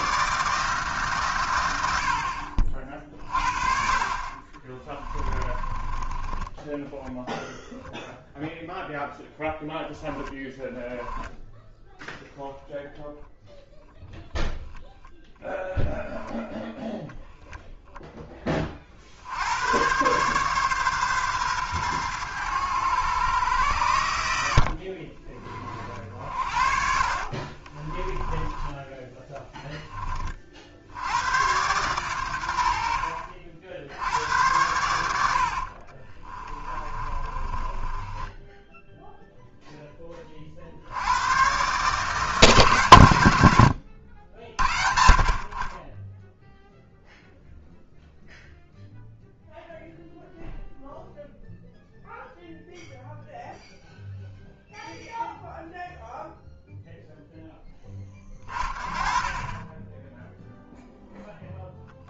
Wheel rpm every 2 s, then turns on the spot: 150, 50, 30, 10, 0, 10, 0, 0, 0, 30, 130, 110, 60, 50, 10, 60, 70, 90, 20, 10, 70, 130, 60, 0, 0, 0, 0, 0, 0, 30, 0.
4-8 26-30 36-40 58-60